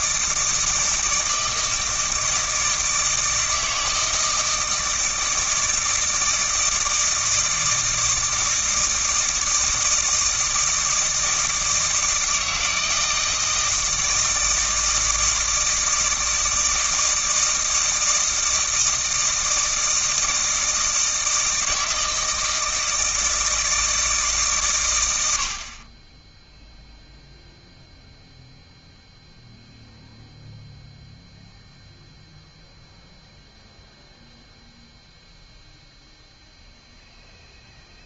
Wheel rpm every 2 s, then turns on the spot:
160, 160, 160, 160, 160, 160, 160, 160, 160, 160, 160, 160, 130, 0, 0, 0, 0, 0, 0.
none